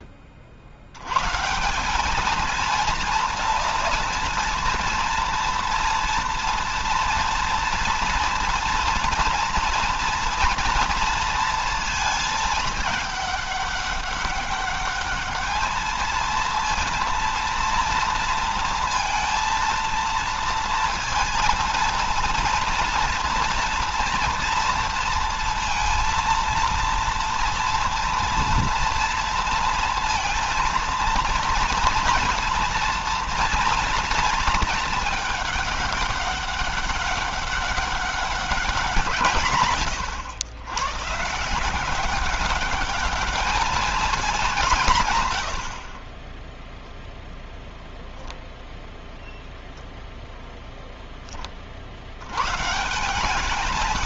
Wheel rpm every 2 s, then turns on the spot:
90, 230, 230, 230, 230, 230, 220, 210, 230, 230, 230, 230, 230, 230, 230, 230, 230, 220, 200, 190, 120, 200, 160, 0, 0, 0, 140.
none